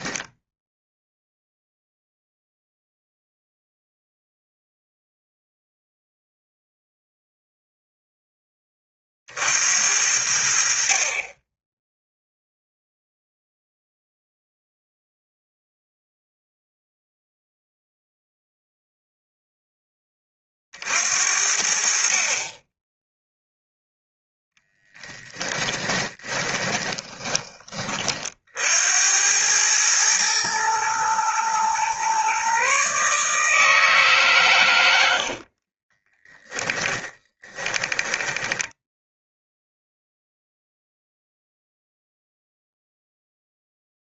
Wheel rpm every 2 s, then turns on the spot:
0, 0, 0, 0, 30, 60, 0, 0, 0, 0, 50, 10, 10, 20, 80, 110, 140, 100, 10, 0, 0, 0.
24-28 34-38